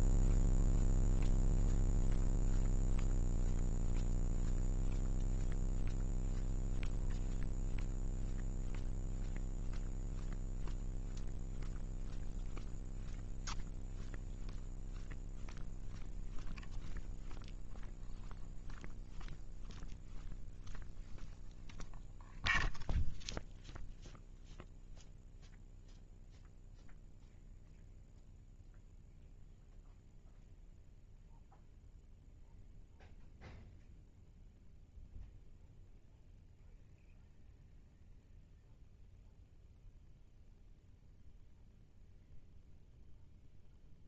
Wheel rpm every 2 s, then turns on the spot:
0, 0, 0, 0, 0, 0, 0, 0, 0, 0, 0, 0, 0, 0, 0, 0, 0, 0, 0, 0, 0, 0.
none